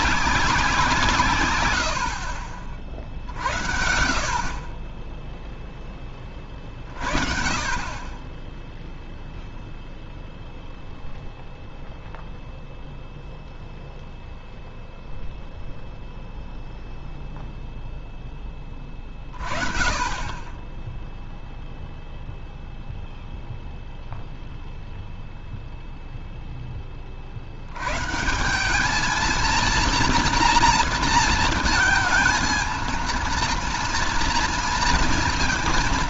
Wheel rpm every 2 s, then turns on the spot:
190, 60, 50, 30, 10, 0, 0, 0, 0, 10, 20, 0, 0, 10, 180, 240, 220, 230.
none